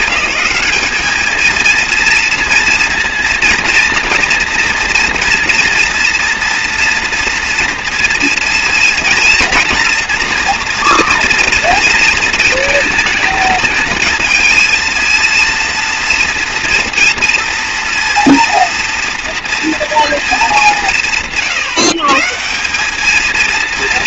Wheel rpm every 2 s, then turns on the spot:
200, 230, 230, 230, 230, 230, 230, 230, 230, 230, 180, 200.
none